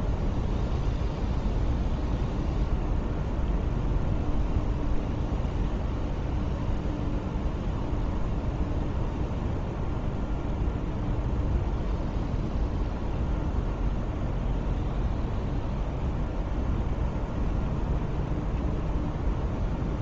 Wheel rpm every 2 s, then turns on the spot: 0, 0, 0, 0, 0, 0, 0, 0, 0, 0.
none